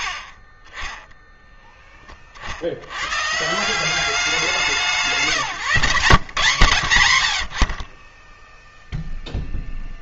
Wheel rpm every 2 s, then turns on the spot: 30, 70, 170, 120, 10.
none